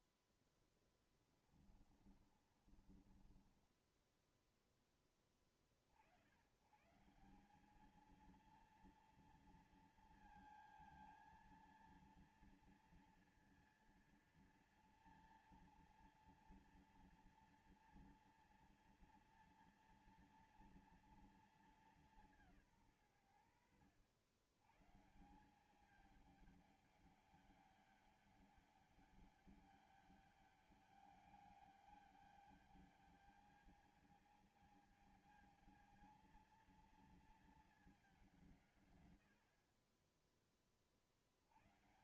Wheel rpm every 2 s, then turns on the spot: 10, 40, 10, 130, 230, 230, 230, 230, 230, 230, 230, 170, 110, 210, 200, 200, 210, 220, 230, 190, 40.
0-4